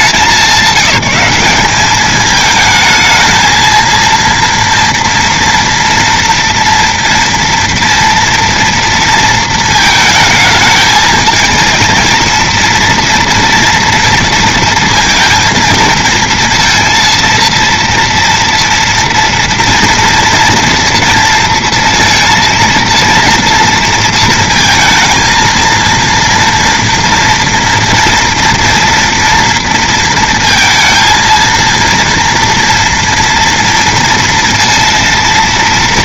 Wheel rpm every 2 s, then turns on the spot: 190, 220, 230, 230, 230, 220, 230, 230, 230, 230, 230, 230, 230, 230, 240, 230, 230, 230.
none